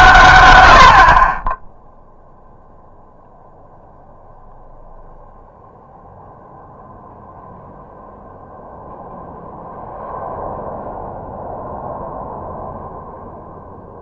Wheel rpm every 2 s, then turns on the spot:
80, 0, 0, 0, 0, 0, 0.
none